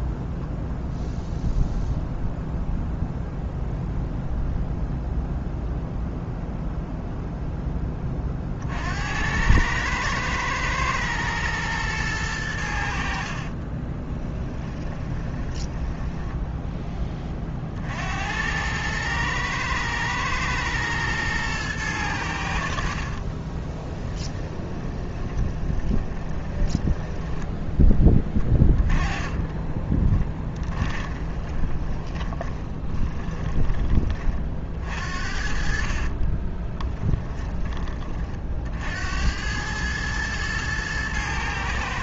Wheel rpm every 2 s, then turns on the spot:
0, 0, 0, 0, 50, 110, 90, 20, 10, 100, 110, 70, 20, 20, 10, 20, 20, 50, 20, 50, 110.
14-16 24-34 36-38